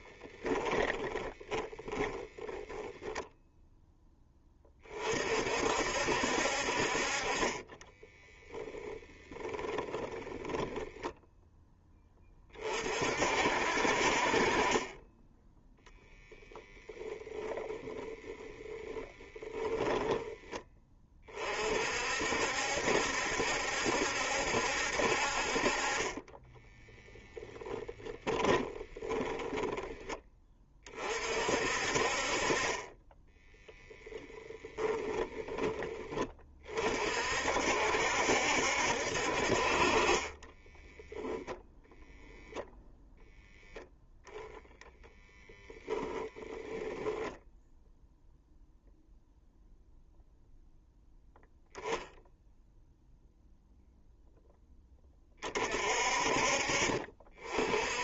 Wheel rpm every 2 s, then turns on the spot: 10, 10, 30, 40, 30, 0, 40, 30, 10, 10, 20, 70, 70, 10, 10, 40, 30, 20, 40, 70, 10, 0, 0, 0, 0, 0, 0, 10, 40.
0-4 8-10 18-20 26-30 34-36 40-42